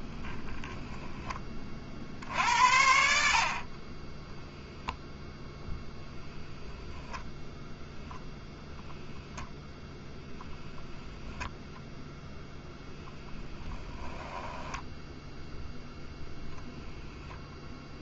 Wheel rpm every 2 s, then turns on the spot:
20, 60, 0, 0, 0, 0, 0, 10, 0.
0-2